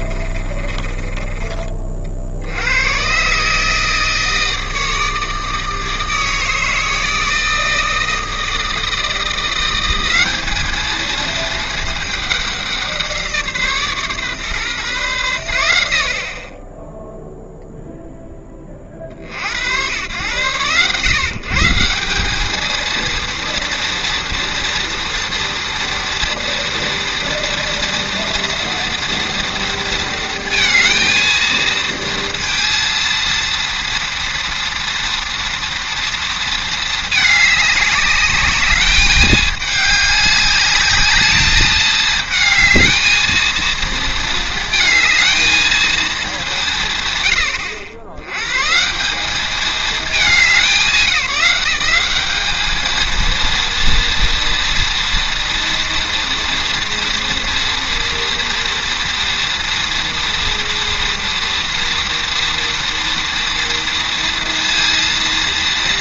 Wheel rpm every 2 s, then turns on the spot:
30, 100, 160, 160, 160, 210, 190, 130, 20, 40, 110, 220, 230, 230, 230, 230, 230, 230, 220, 200, 210, 220, 220, 160, 150, 180, 220, 230, 230, 230, 230, 240, 230.
0-2